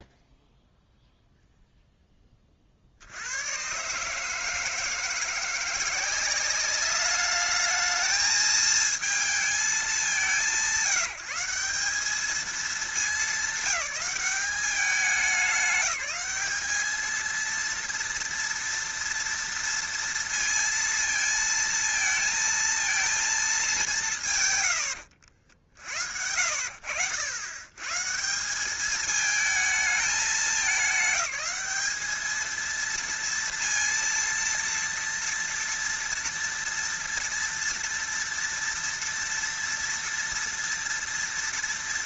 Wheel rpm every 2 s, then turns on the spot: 0, 50, 160, 200, 220, 160, 210, 190, 210, 230, 230, 230, 110, 70, 200, 210, 220, 230, 230, 230, 230.
none